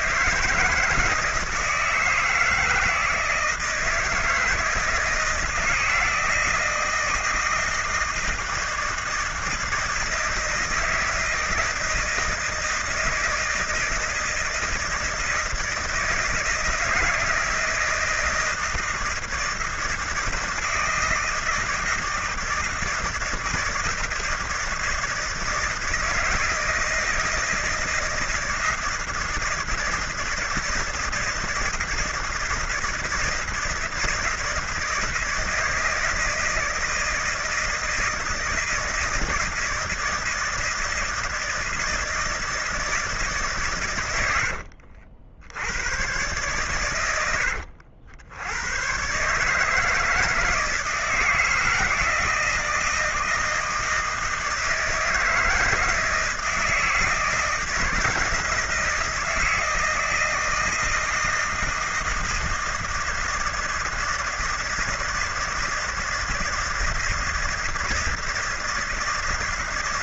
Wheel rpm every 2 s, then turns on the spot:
160, 160, 150, 160, 160, 160, 170, 160, 160, 160, 170, 160, 160, 160, 160, 160, 170, 160, 160, 160, 160, 160, 80, 120, 100, 160, 160, 160, 160, 160, 160, 160, 160, 160, 160.
44-46